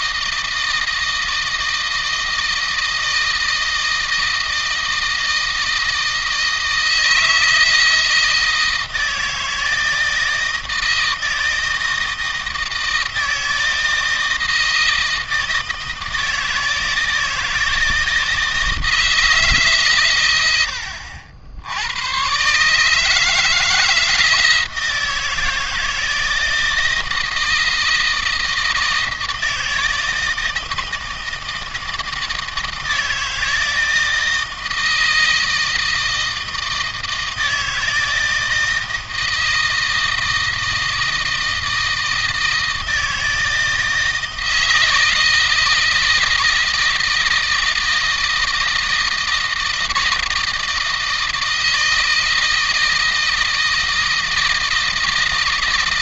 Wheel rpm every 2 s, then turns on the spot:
160, 160, 160, 160, 160, 160, 160, 160, 160, 160, 80, 150, 160, 160, 160, 160, 160, 160, 160, 160, 160, 160, 160, 160, 160, 160, 160, 160.
none